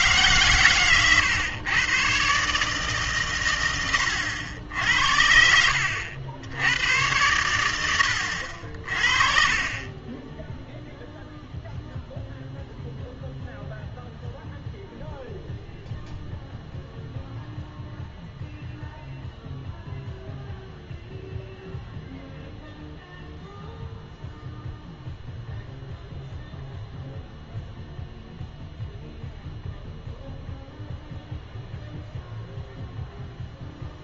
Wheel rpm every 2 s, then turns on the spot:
120, 140, 80, 90, 60, 0, 0, 0, 0, 0, 0, 0, 0, 0, 0, 0, 0.
none